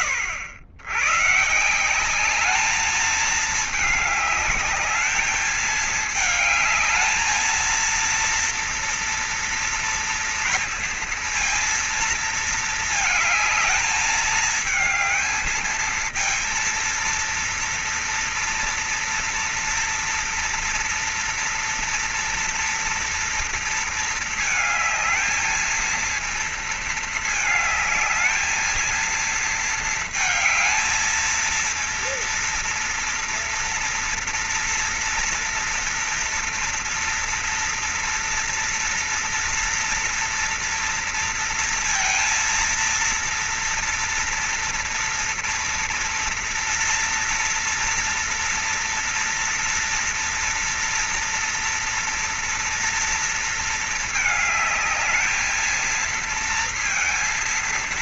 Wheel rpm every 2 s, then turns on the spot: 110, 210, 220, 220, 240, 230, 220, 220, 230, 230, 230, 230, 220, 220, 220, 220, 230, 240, 240, 230, 230, 230, 230, 230, 240, 240, 240, 220, 230.
none